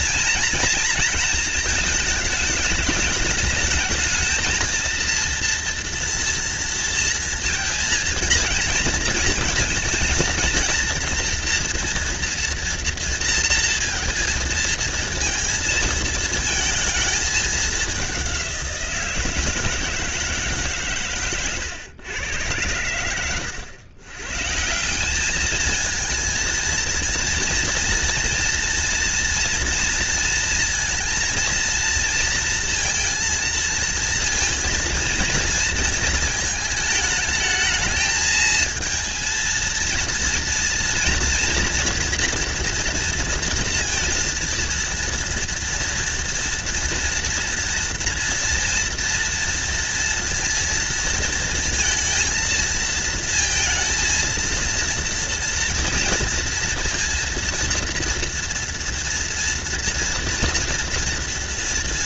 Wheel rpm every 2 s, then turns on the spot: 230, 220, 230, 230, 230, 230, 230, 230, 220, 170, 130, 100, 190, 230, 230, 230, 230, 230, 220, 220, 240, 230, 230, 240, 230, 230, 220, 230, 230, 230, 230.
none